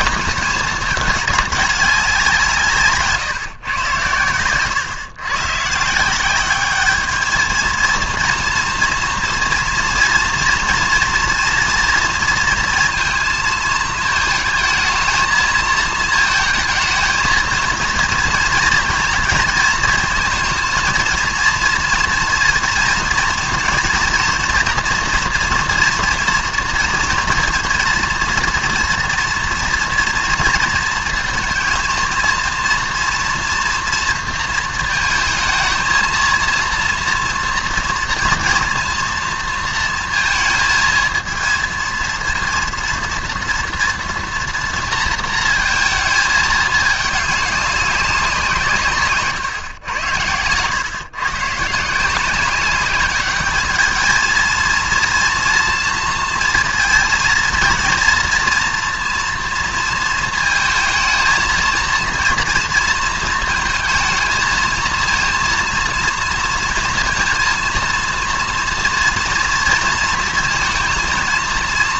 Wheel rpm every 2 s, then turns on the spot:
210, 160, 110, 210, 240, 230, 230, 220, 220, 230, 230, 230, 230, 230, 230, 230, 230, 220, 230, 230, 230, 230, 230, 210, 150, 120, 200, 230, 230, 230, 230, 230, 220, 230, 230, 230.
none